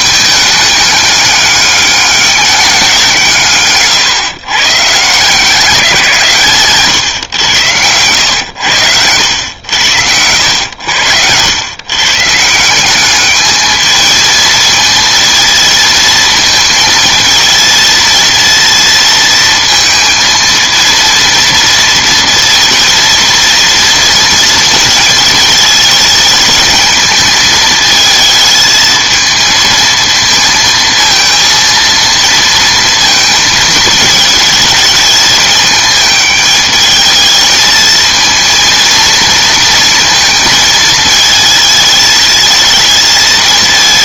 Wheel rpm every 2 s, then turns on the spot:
210, 200, 130, 150, 110, 80, 160, 230, 230, 230, 220, 230, 230, 210, 220, 220, 230, 220, 210, 230, 220, 220.
none